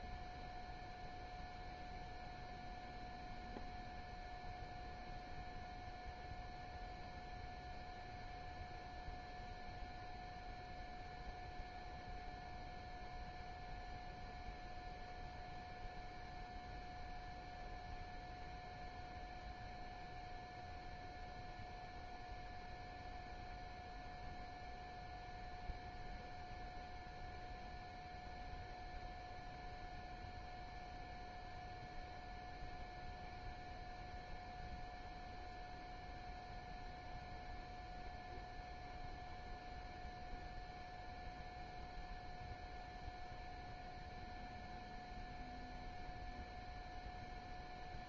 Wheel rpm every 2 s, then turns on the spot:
0, 0, 0, 0, 0, 0, 0, 0, 0, 0, 0, 0, 0, 0, 0, 0, 0, 0, 0, 0, 0, 0, 0, 0.
none